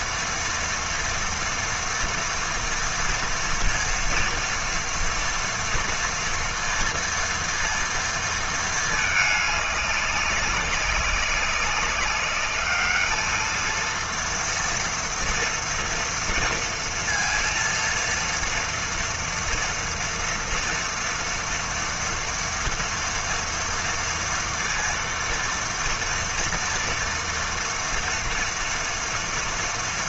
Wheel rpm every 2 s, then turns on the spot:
230, 230, 230, 230, 220, 200, 220, 230, 230, 240, 230, 230, 230, 230, 230.
none